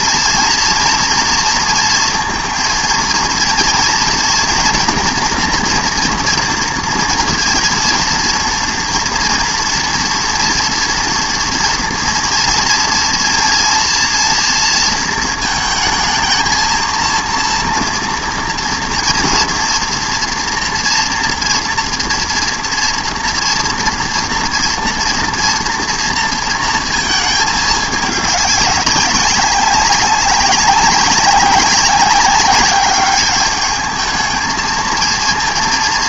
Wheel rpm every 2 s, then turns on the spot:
230, 230, 230, 230, 230, 230, 230, 230, 220, 240, 230, 230, 240, 230, 200, 200, 190, 220.
none